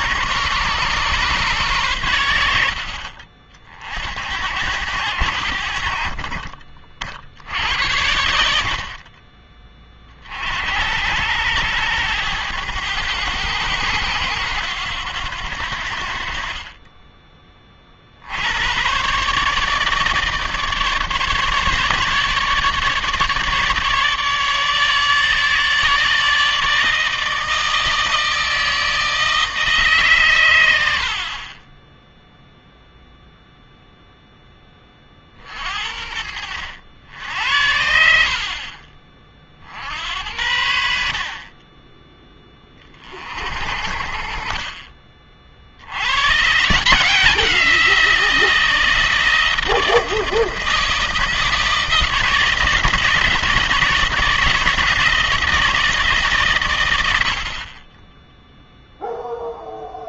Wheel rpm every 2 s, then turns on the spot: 140, 60, 90, 50, 50, 80, 100, 100, 20, 110, 150, 150, 150, 160, 160, 90, 0, 20, 80, 30, 70, 30, 40, 160, 160, 160, 160, 160, 110, 0.
none